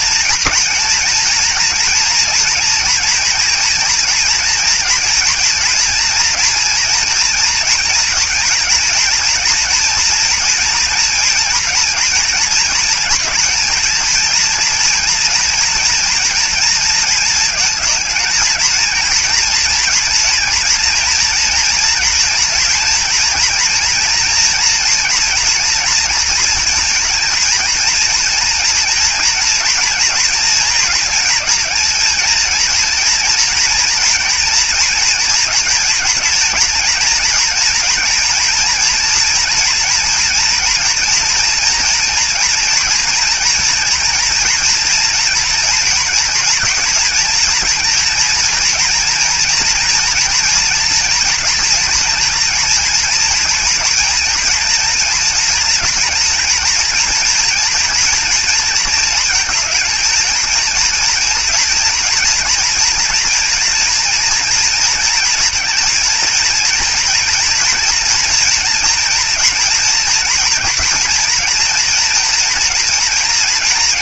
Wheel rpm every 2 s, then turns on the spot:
240, 230, 230, 230, 230, 240, 230, 230, 220, 230, 240, 240, 230, 230, 230, 230, 230, 230, 230, 230, 230, 230, 240, 230, 230, 240, 240, 230, 230, 230, 230, 230, 240, 230, 230, 230, 240.
none